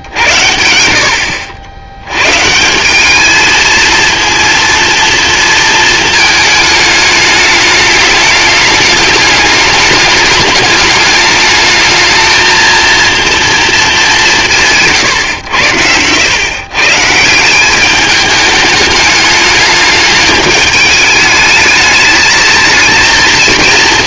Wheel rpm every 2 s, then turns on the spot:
80, 170, 230, 220, 210, 210, 230, 160, 130, 220, 210, 220.
none